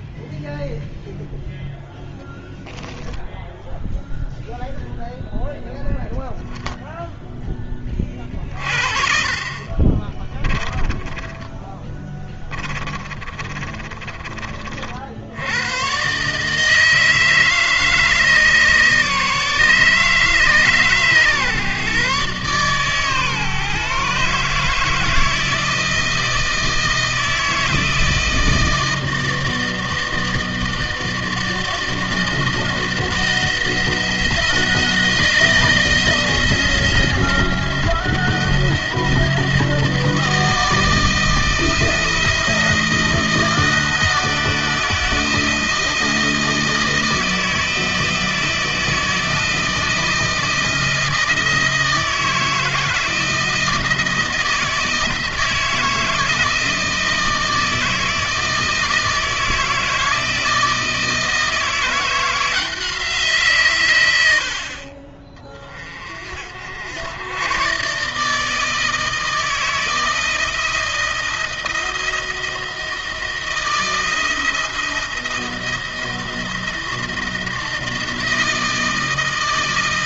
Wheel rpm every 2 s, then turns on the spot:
0, 10, 0, 0, 40, 30, 20, 60, 160, 150, 140, 140, 150, 160, 160, 160, 160, 170, 160, 160, 160, 160, 160, 160, 160, 160, 160, 160, 160, 160, 160, 170, 40, 80, 160, 160, 160, 160, 170, 160.
10-14